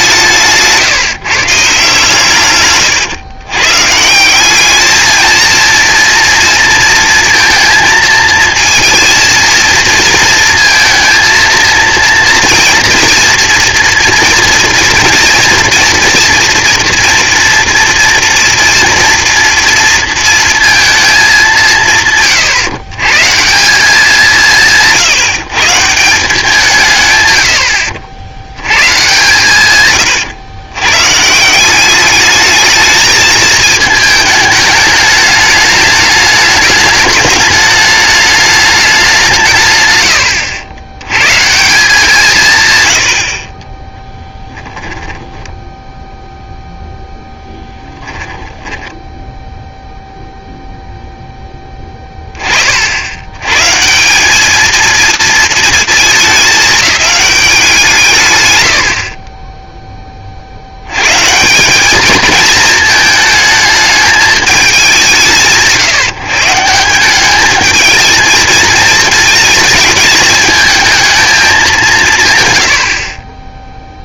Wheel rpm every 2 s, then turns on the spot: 150, 130, 210, 230, 220, 230, 240, 230, 230, 230, 220, 130, 160, 160, 110, 120, 220, 210, 210, 210, 100, 110, 10, 0, 10, 0, 50, 220, 210, 80, 80, 220, 200, 180, 220, 220, 90.
44-46 48-50